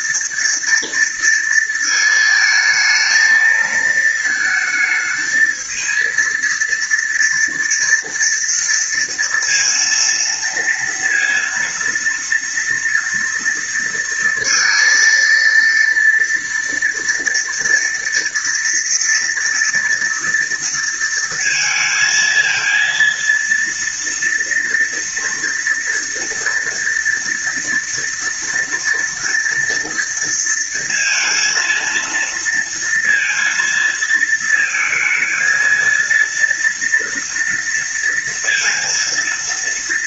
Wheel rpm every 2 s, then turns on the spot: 230, 220, 220, 230, 230, 230, 230, 230, 230, 230, 230, 230, 230, 230, 230, 230, 230, 220, 230, 230.
none